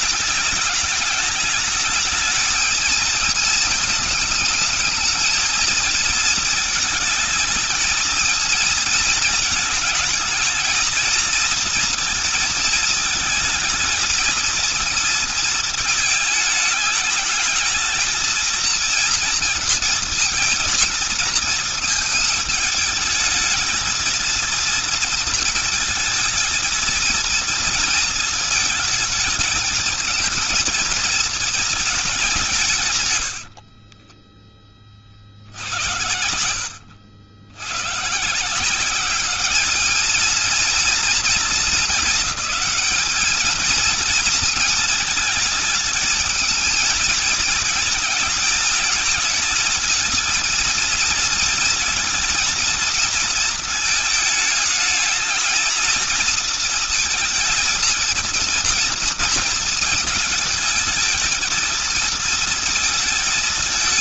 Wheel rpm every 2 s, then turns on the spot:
210, 220, 220, 220, 230, 230, 230, 230, 220, 230, 230, 220, 230, 230, 230, 220, 180, 20, 90, 150, 220, 200, 230, 220, 220, 220, 230, 220, 230, 230, 220, 220.
none